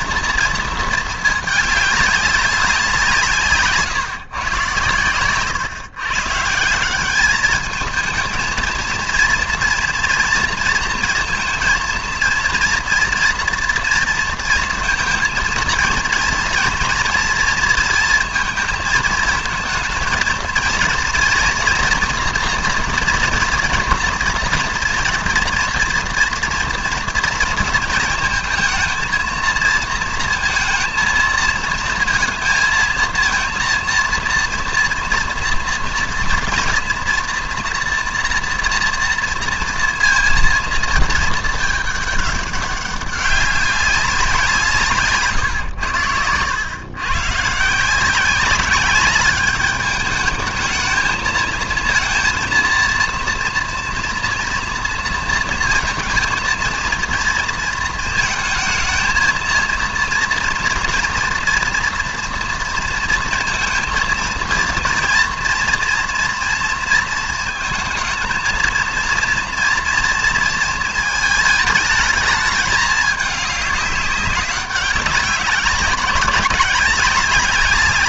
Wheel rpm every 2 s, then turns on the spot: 230, 190, 120, 170, 230, 230, 240, 230, 240, 220, 240, 240, 230, 230, 230, 230, 230, 230, 230, 230, 230, 200, 160, 110, 200, 210, 230, 230, 230, 220, 230, 230, 230, 230, 220, 230, 220, 200, 200.
none